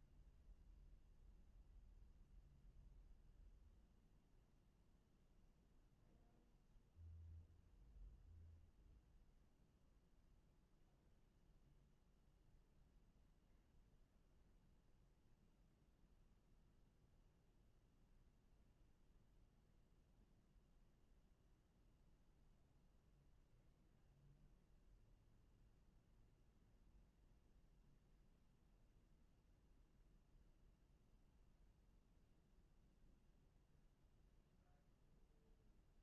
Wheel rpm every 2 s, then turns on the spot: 0, 0, 0, 0, 0, 0, 0, 0, 0, 0, 0, 0, 0, 0, 0, 0, 0, 0.
none